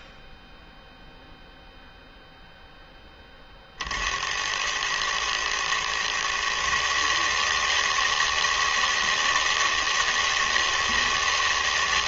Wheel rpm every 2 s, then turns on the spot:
0, 20, 110, 150, 160, 160.
none